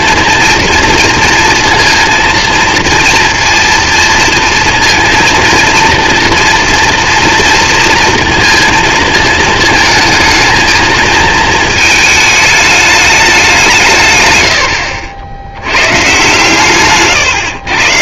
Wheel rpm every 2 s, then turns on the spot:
230, 230, 230, 230, 230, 220, 210, 90, 140.
none